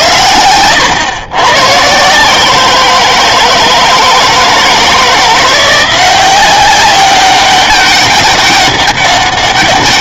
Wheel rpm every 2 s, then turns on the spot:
100, 170, 160, 190, 200.
none